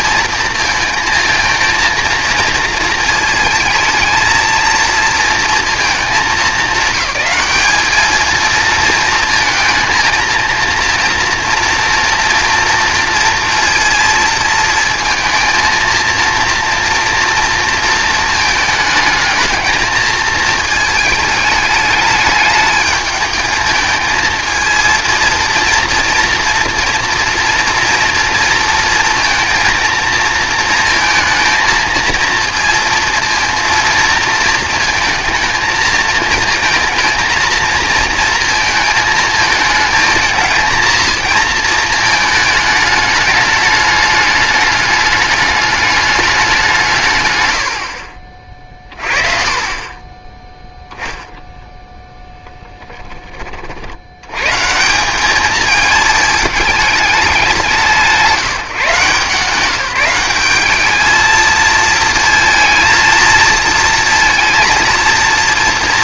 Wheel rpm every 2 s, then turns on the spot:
220, 220, 230, 200, 220, 230, 230, 220, 230, 220, 220, 220, 220, 230, 230, 230, 230, 220, 230, 220, 220, 210, 210, 180, 30, 0, 20, 150, 210, 160, 210, 230, 230.
none